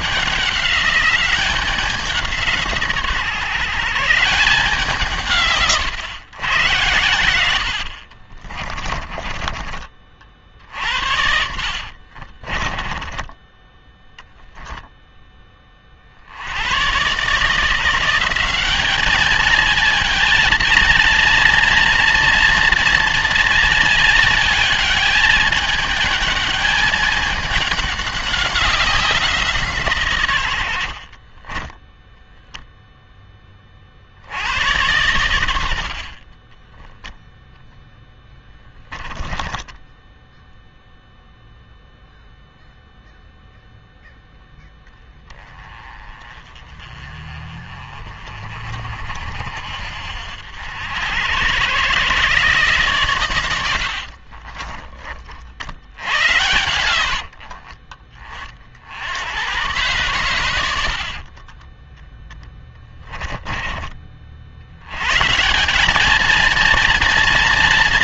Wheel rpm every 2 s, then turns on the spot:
190, 160, 170, 100, 30, 60, 20, 0, 100, 200, 230, 230, 210, 210, 190, 70, 0, 90, 10, 10, 0, 0, 0, 30, 50, 90, 140, 30, 90, 60, 80, 10, 100, 230.
8-10 12-14 30-32 36-40 54-56 60-64